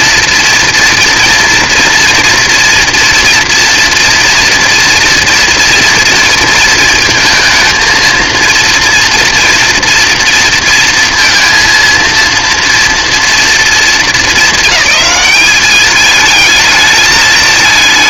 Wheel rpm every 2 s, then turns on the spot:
240, 240, 240, 220, 230, 230, 230, 210, 220.
none